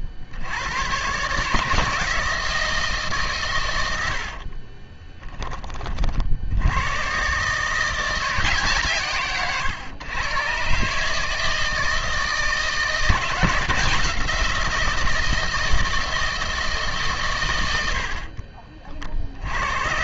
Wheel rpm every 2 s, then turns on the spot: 80, 160, 50, 80, 160, 130, 160, 170, 160, 40.
4-6 18-20